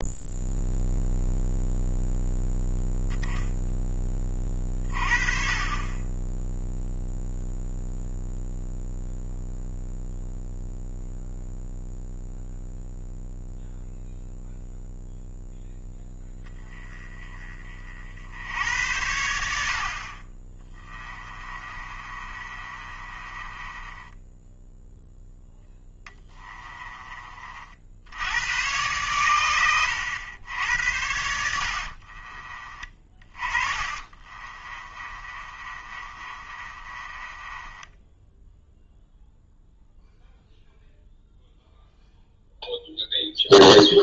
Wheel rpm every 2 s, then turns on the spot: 0, 0, 30, 0, 0, 0, 0, 0, 10, 80, 20, 30, 0, 20, 110, 80, 30, 30, 30, 0, 0, 0.
20-24 26-28 32-38